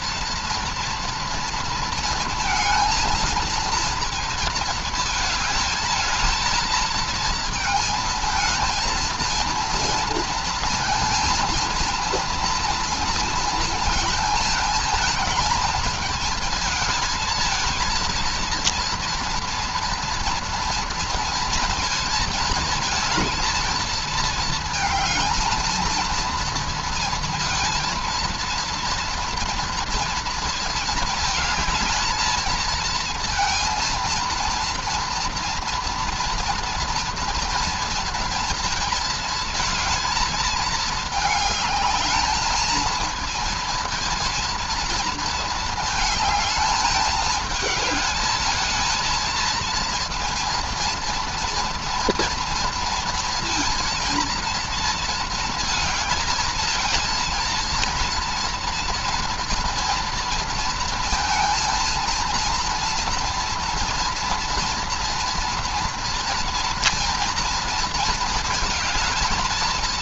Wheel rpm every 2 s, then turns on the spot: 230, 230, 230, 220, 220, 230, 230, 220, 220, 230, 230, 220, 220, 230, 230, 230, 220, 230, 230, 230, 220, 220, 230, 220, 220, 230, 230, 230, 230, 230, 230, 230, 230, 230, 220.
none